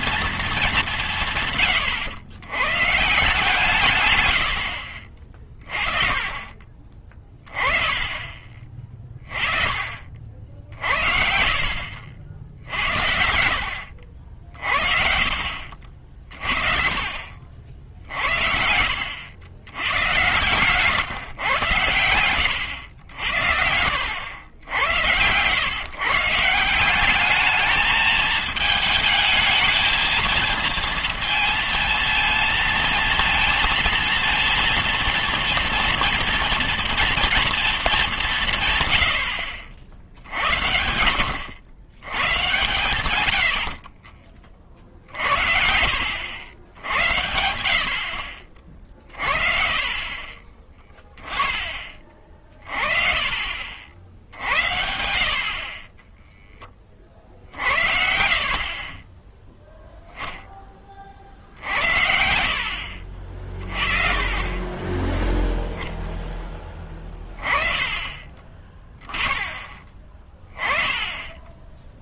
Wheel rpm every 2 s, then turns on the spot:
220, 120, 70, 30, 30, 60, 70, 60, 40, 70, 130, 110, 80, 180, 220, 230, 230, 230, 230, 150, 80, 120, 50, 90, 50, 20, 30, 70, 30, 30, 10, 60, 20, 20, 20, 10.
58-60 62-64